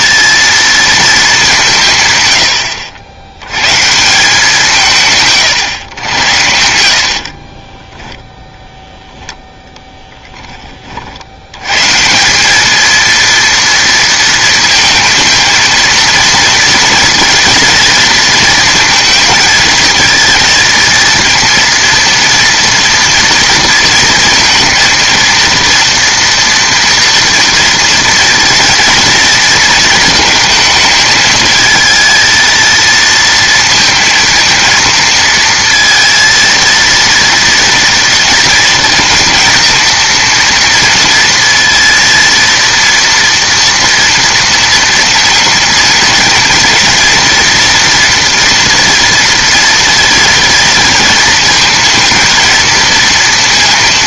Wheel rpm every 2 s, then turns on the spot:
230, 90, 170, 70, 0, 20, 200, 220, 230, 230, 230, 230, 230, 240, 230, 220, 230, 220, 230, 230, 230, 230, 230, 240, 230, 230, 230.
none